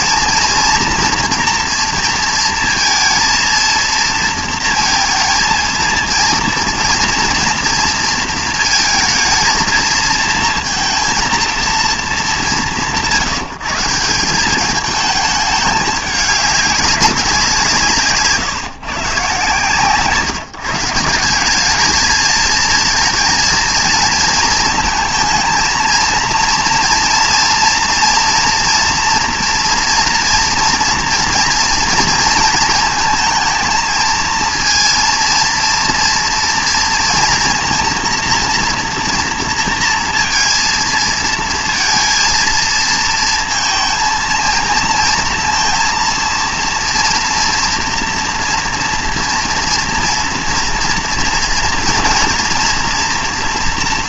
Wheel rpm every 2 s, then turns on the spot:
230, 230, 230, 230, 230, 230, 160, 200, 200, 150, 150, 220, 230, 230, 240, 230, 220, 230, 230, 230, 230, 230, 230, 230, 240, 240, 230.
none